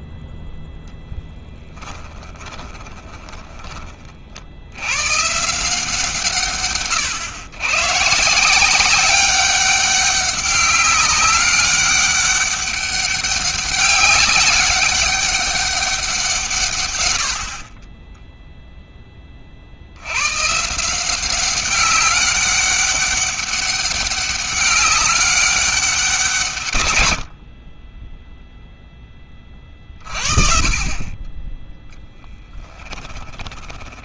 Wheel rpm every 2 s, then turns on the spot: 10, 20, 100, 130, 170, 200, 200, 200, 130, 0, 140, 200, 200, 130, 0, 40, 20.
2-4 32-34